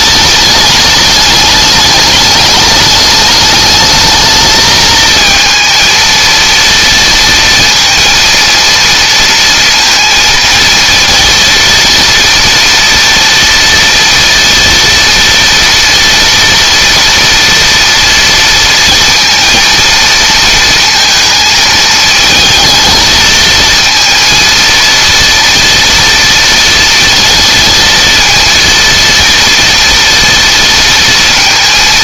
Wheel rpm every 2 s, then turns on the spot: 210, 210, 220, 230, 230, 230, 230, 230, 240, 230, 230, 220, 230, 230, 230, 230.
none